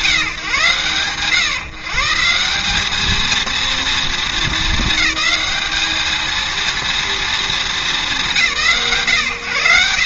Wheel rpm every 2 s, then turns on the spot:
150, 190, 220, 230, 130.
none